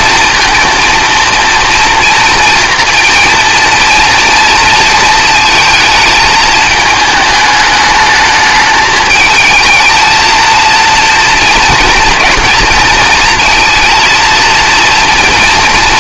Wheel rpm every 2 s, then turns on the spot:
230, 230, 230, 220, 220, 230, 230, 230.
none